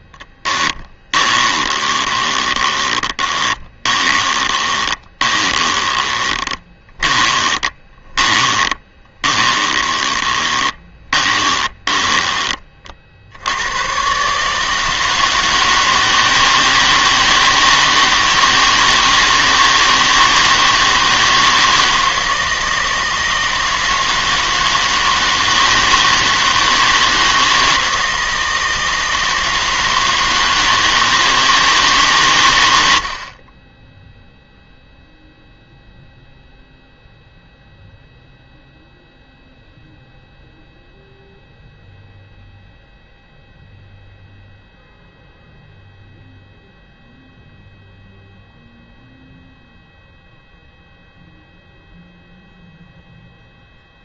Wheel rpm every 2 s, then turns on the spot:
20, 20, 20, 20, 20, 20, 50, 160, 160, 160, 160, 160, 160, 160, 160, 160, 80, 0, 0, 0, 0, 0, 0, 0, 0, 0, 0.
0-12